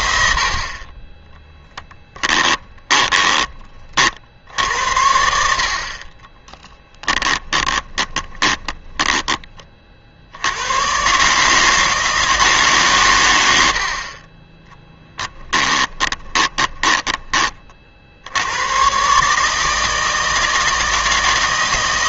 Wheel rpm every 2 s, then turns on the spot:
40, 20, 80, 20, 20, 100, 150, 20, 10, 110, 160.
2-4 6-10 14-18